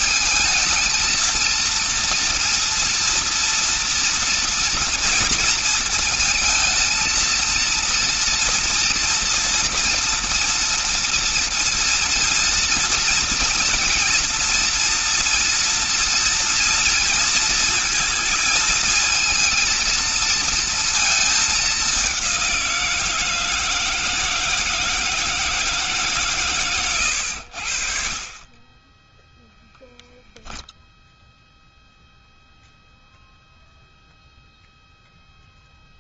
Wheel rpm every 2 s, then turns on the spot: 220, 230, 230, 220, 230, 240, 230, 230, 230, 220, 220, 170, 160, 110, 10, 0, 0, 0.
none